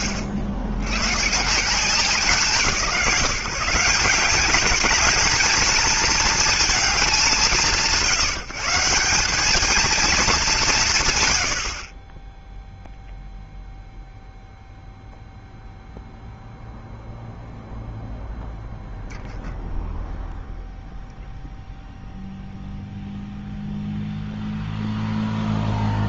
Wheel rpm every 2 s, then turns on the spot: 70, 160, 210, 220, 170, 150, 0, 0, 0, 0, 0, 0, 0.
none